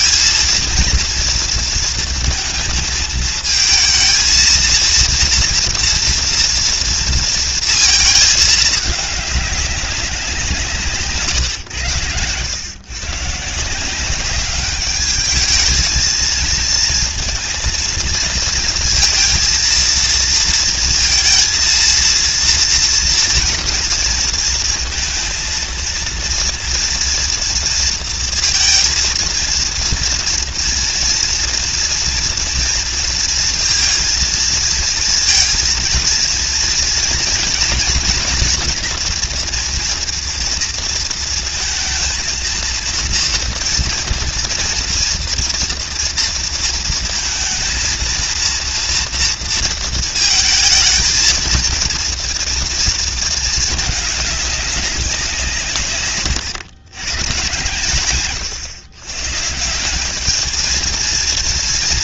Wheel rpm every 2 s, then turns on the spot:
230, 220, 230, 230, 200, 130, 150, 210, 230, 230, 230, 230, 230, 230, 230, 230, 230, 230, 240, 230, 230, 240, 230, 230, 230, 230, 230, 190, 130, 130, 230.
none